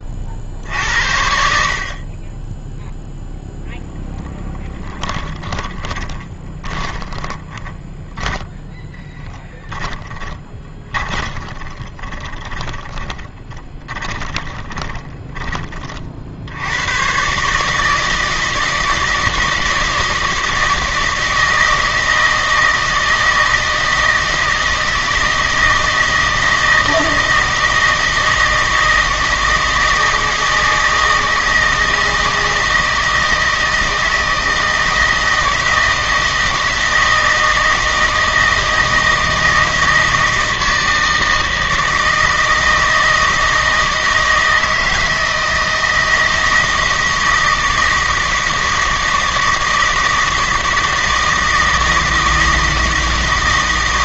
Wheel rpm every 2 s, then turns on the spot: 60, 10, 10, 10, 10, 20, 20, 20, 90, 160, 160, 160, 160, 160, 160, 160, 160, 160, 160, 160, 160, 160, 160, 160, 160, 160, 160.
4-8 10-16